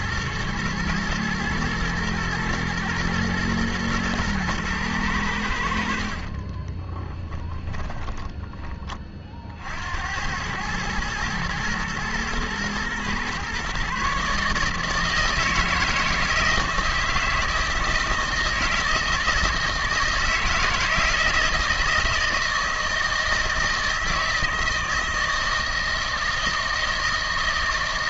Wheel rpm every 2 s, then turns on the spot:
120, 110, 100, 20, 20, 110, 120, 160, 160, 160, 160, 160, 160, 160.
6-8